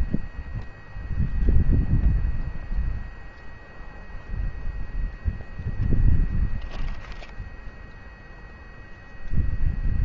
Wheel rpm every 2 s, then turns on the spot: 0, 0, 0, 0, 0.
none